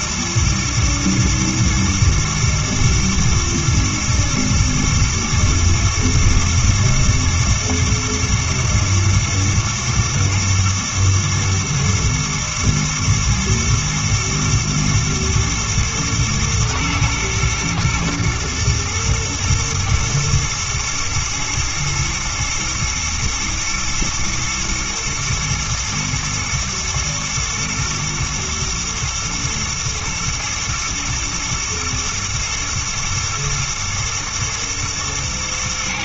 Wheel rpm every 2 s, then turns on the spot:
110, 110, 110, 110, 110, 110, 110, 120, 110, 110, 120, 110, 110, 110, 120, 110, 110, 110.
none